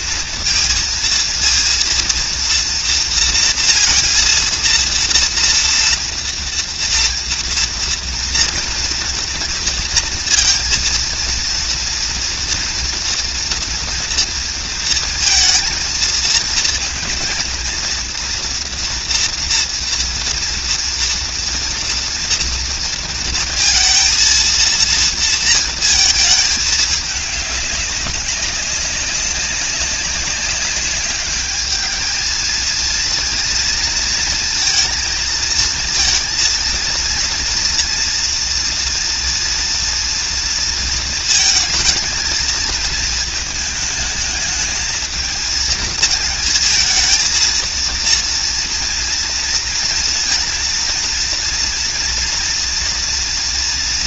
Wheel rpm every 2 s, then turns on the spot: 230, 230, 230, 230, 230, 230, 230, 230, 230, 240, 230, 230, 230, 220, 200, 200, 220, 230, 230, 230, 230, 230, 220, 220, 230, 230, 230.
none